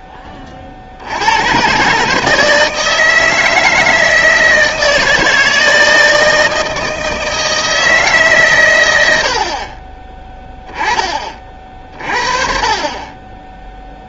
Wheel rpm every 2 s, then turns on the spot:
40, 160, 160, 160, 120, 20, 30.
none